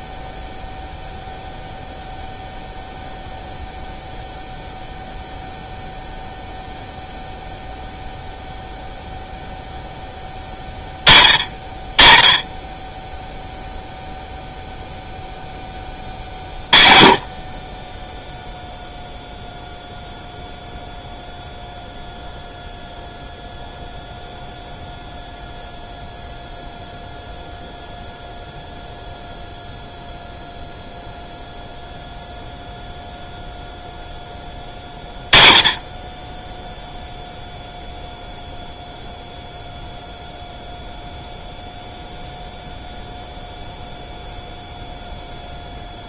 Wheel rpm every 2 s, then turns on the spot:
0, 0, 0, 0, 0, 30, 10, 0, 30, 0, 0, 0, 0, 0, 0, 0, 0, 10, 0, 0, 0, 0, 0.
none